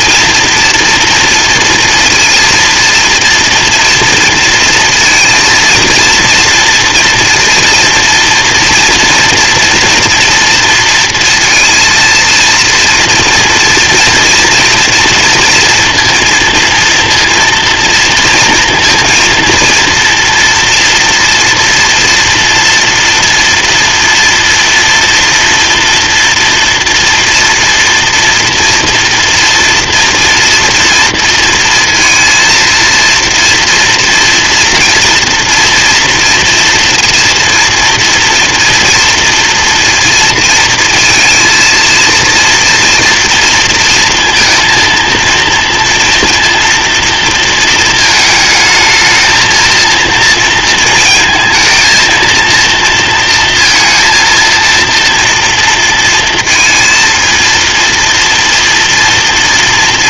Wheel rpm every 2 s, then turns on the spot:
230, 230, 230, 240, 230, 230, 230, 230, 230, 230, 230, 230, 240, 230, 230, 230, 230, 230, 240, 230, 230, 230, 230, 230, 220, 230, 230, 230, 230, 230.
none